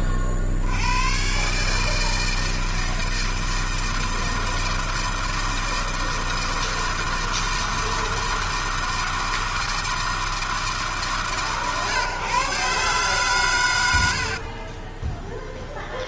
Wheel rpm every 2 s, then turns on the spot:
90, 160, 160, 160, 160, 160, 140, 70.
14-16